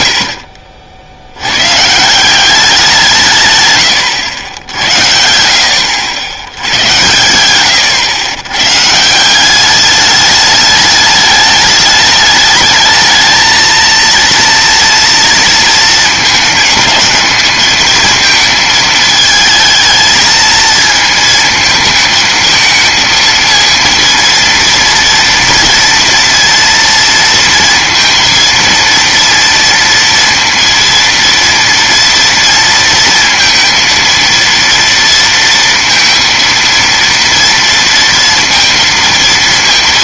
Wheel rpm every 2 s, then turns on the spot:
60, 190, 80, 90, 120, 210, 220, 230, 210, 220, 220, 220, 230, 230, 230, 230, 230, 230, 230, 230.
none